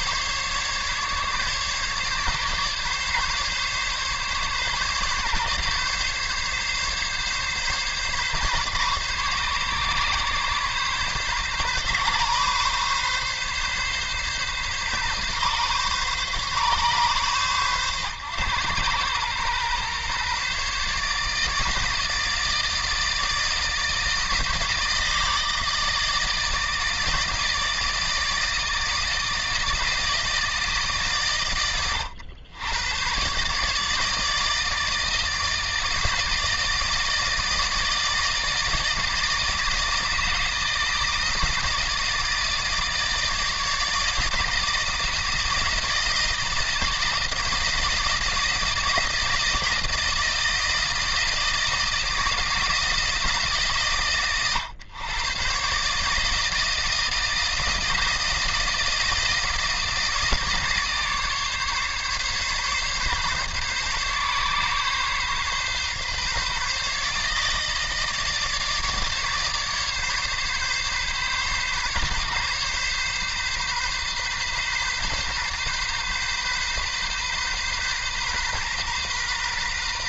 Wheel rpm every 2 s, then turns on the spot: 140, 140, 140, 140, 140, 130, 140, 140, 130, 120, 140, 160, 160, 160, 160, 130, 100, 160, 150, 160, 160, 160, 160, 160, 170, 160, 160, 110, 160, 160, 150, 140, 130, 150, 150, 140, 140, 130, 130, 130.
none